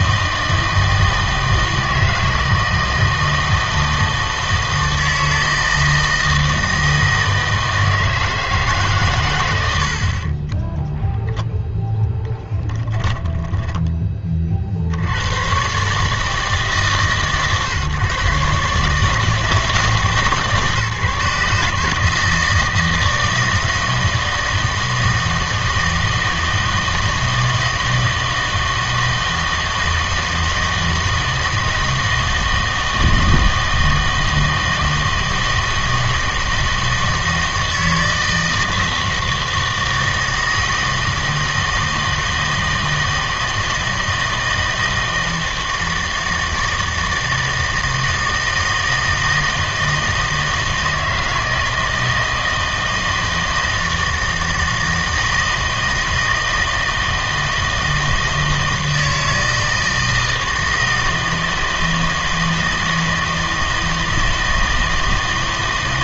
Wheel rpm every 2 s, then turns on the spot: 160, 160, 160, 160, 150, 10, 10, 50, 150, 140, 150, 160, 160, 160, 160, 160, 160, 160, 160, 160, 160, 160, 160, 160, 160, 160, 160, 160, 160, 160, 160, 160, 160.
10-14